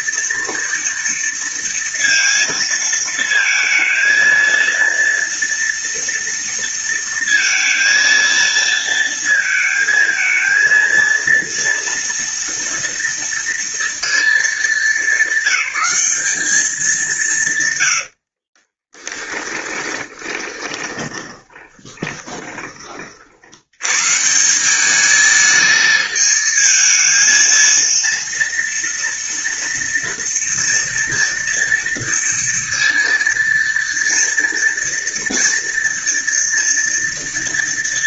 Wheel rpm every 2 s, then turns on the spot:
230, 220, 230, 230, 230, 230, 240, 220, 190, 20, 10, 30, 190, 220, 230, 230, 230, 230, 230.
18-22